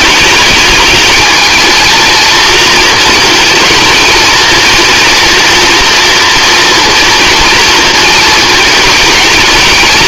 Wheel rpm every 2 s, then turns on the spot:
220, 230, 220, 230, 220.
none